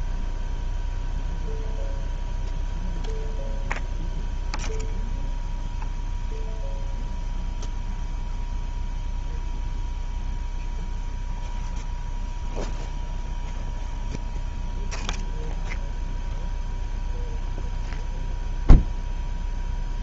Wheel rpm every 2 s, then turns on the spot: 0, 0, 0, 0, 0, 0, 0, 0, 0, 0.
none